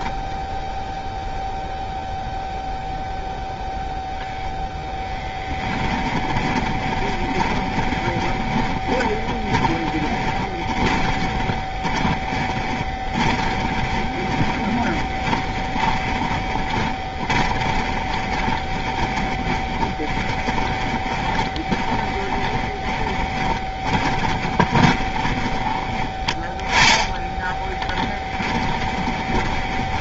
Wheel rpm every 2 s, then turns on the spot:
0, 0, 10, 20, 30, 20, 20, 20, 20, 20, 20, 10, 20, 10, 20.
4-30